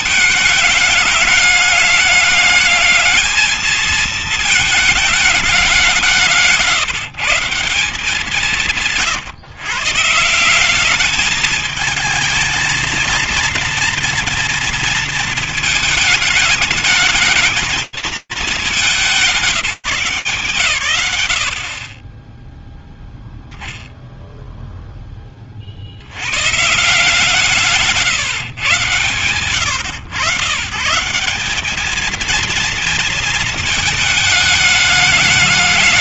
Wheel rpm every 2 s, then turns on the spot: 210, 220, 220, 160, 150, 200, 230, 230, 220, 180, 90, 0, 10, 150, 130, 150, 230, 210.
none